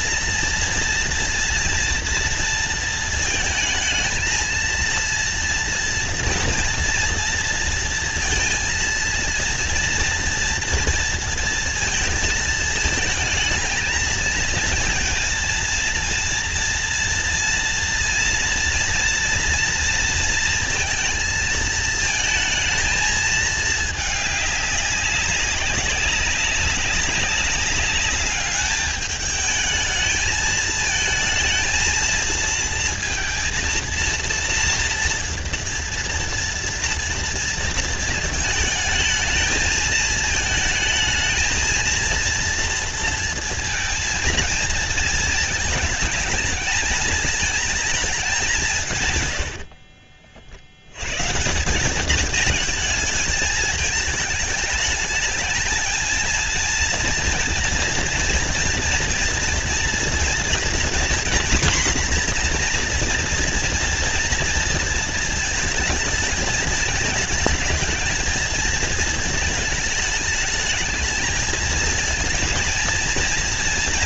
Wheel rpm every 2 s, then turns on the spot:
230, 230, 230, 230, 230, 230, 220, 230, 230, 240, 230, 220, 200, 190, 210, 220, 230, 240, 240, 220, 220, 230, 230, 220, 200, 70, 220, 210, 230, 240, 240, 240, 230, 220, 220, 210, 230.
none